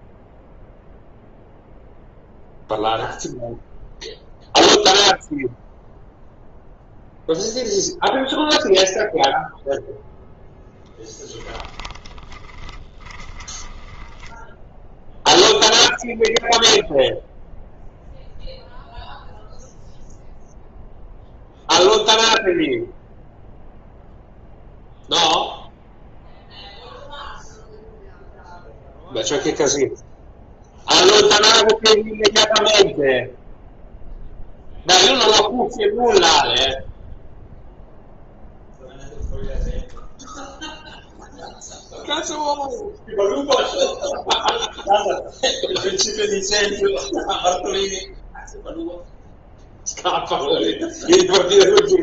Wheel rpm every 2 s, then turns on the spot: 0, 0, 0, 0, 0, 10, 20, 0, 0, 0, 0, 0, 0, 0, 0, 0, 0, 0, 0, 0, 0, 0, 0, 0, 0, 0.
10-14